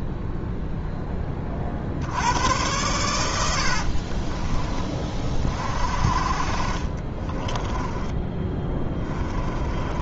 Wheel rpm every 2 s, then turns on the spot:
0, 100, 40, 40, 10.
8-10